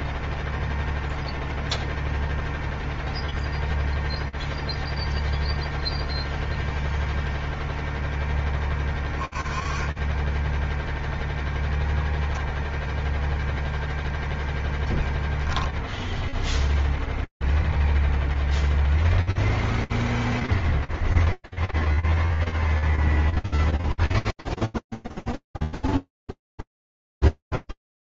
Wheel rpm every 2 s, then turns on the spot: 0, 0, 0, 0, 10, 10, 0, 0, 0, 0, 0, 0, 0, 0.
none